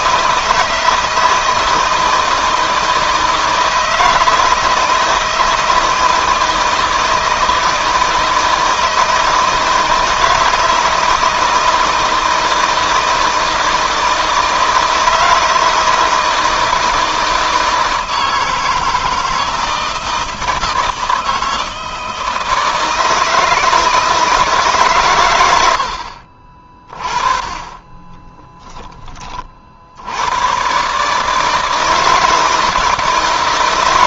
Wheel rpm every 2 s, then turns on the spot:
170, 160, 160, 160, 160, 160, 160, 160, 160, 160, 160, 160, 140, 40, 10, 140, 160.
none